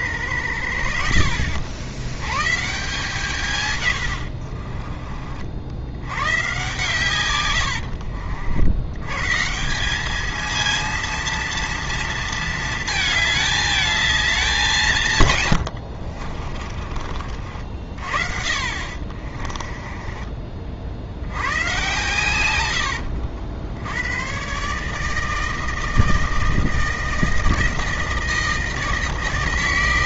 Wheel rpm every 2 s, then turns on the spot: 60, 150, 50, 120, 90, 230, 220, 170, 40, 40, 60, 90, 150, 160, 160.
4-6 16-20